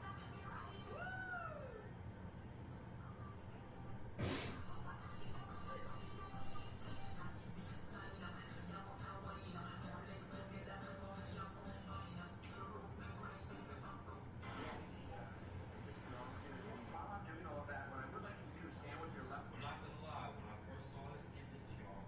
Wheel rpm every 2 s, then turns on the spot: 0, 0, 0, 0, 0, 0, 0, 0, 0, 0, 0.
none